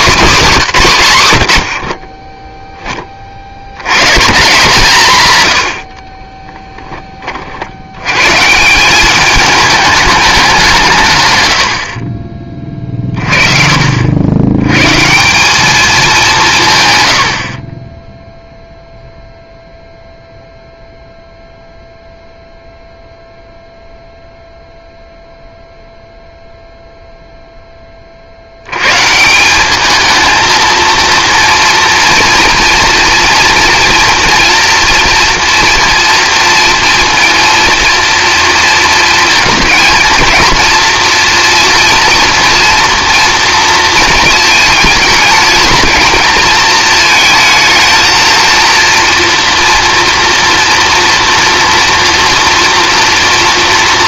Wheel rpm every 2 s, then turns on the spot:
190, 10, 160, 10, 170, 170, 30, 120, 160, 0, 0, 0, 0, 0, 100, 220, 230, 230, 230, 230, 230, 240, 220, 220, 230, 230, 230.
none